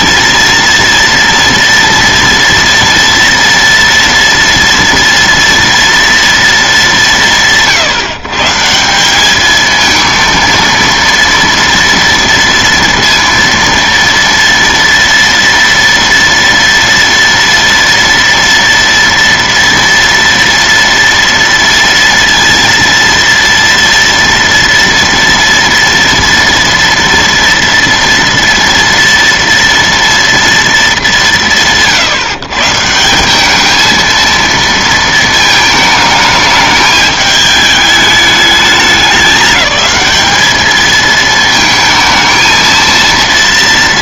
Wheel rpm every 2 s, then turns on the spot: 230, 230, 230, 210, 170, 230, 230, 230, 230, 230, 230, 230, 230, 230, 230, 220, 150, 230, 220, 210, 220, 230.
none